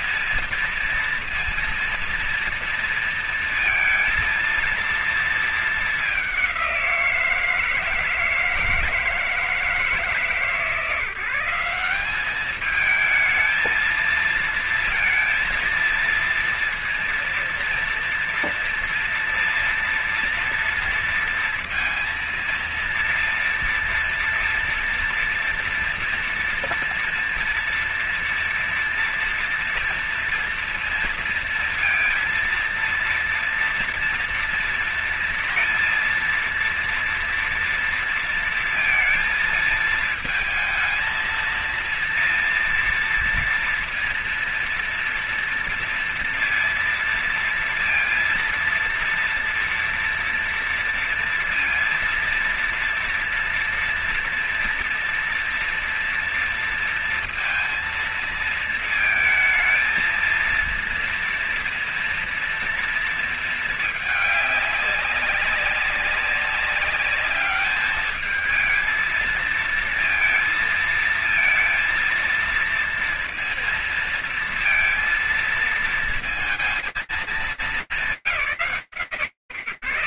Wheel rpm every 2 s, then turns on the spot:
230, 230, 230, 200, 160, 160, 190, 220, 230, 230, 230, 230, 230, 240, 240, 230, 230, 230, 230, 230, 220, 230, 230, 230, 230, 230, 230, 240, 230, 230, 230, 230, 210, 190, 210, 230, 230, 230, 230, 140.
none